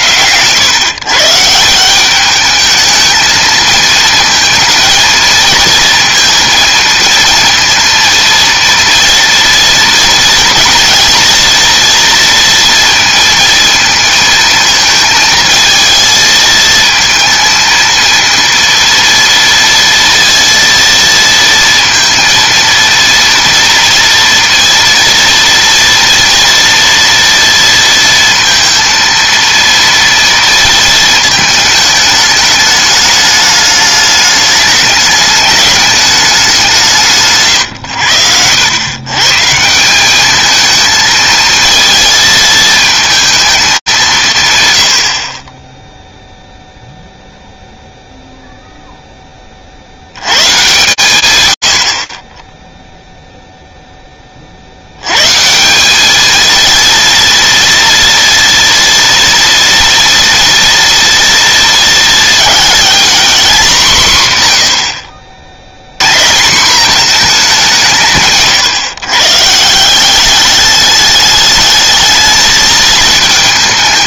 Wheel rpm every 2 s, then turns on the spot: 110, 210, 230, 230, 230, 230, 230, 220, 220, 230, 230, 230, 240, 230, 230, 220, 210, 210, 180, 100, 220, 220, 90, 0, 0, 120, 0, 110, 230, 230, 240, 240, 90, 210, 120, 210, 220.
none